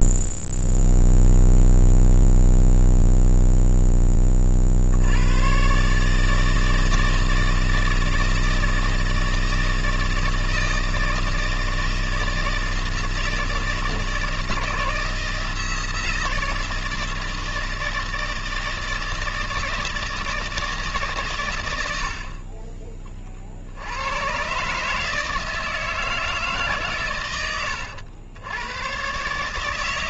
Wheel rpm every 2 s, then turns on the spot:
0, 0, 30, 160, 160, 160, 160, 160, 160, 160, 160, 50, 120, 160, 100.
22-24